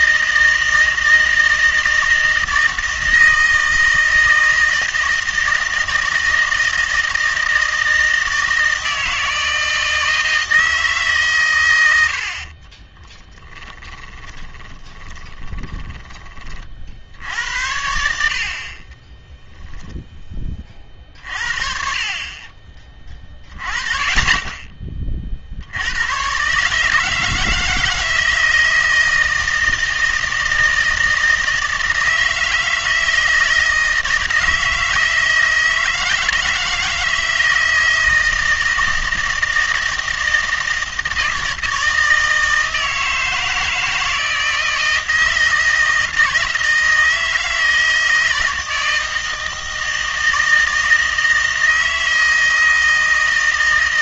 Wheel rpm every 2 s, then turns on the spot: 160, 160, 160, 160, 160, 160, 30, 20, 50, 40, 40, 30, 20, 140, 160, 160, 160, 160, 160, 160, 160, 160, 160, 160, 160, 160, 160.
12-16 18-20